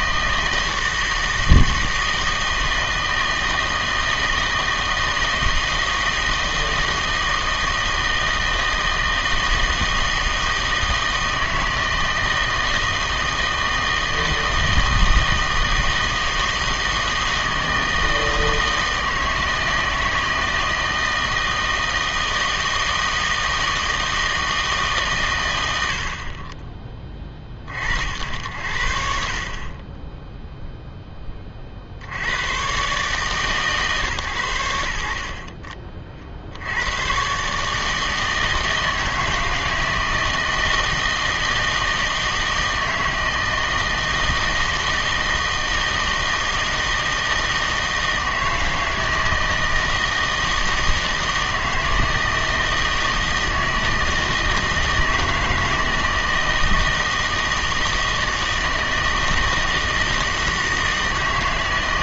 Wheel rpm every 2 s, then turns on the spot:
160, 160, 160, 160, 160, 160, 160, 160, 160, 160, 160, 160, 150, 20, 60, 0, 120, 80, 70, 160, 160, 160, 160, 160, 160, 160, 160, 160, 160, 160, 160.
none